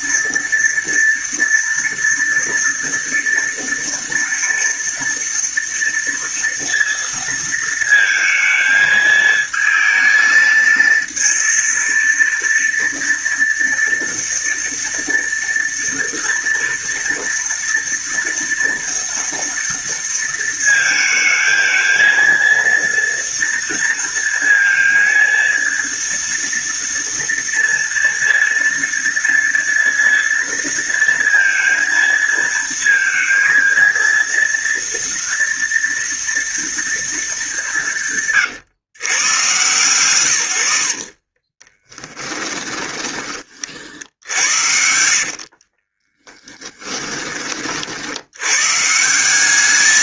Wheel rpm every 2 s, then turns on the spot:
230, 240, 230, 230, 220, 230, 230, 240, 230, 230, 220, 230, 230, 230, 230, 230, 230, 230, 230, 130, 50, 30, 70, 20, 170.
40-42 44-48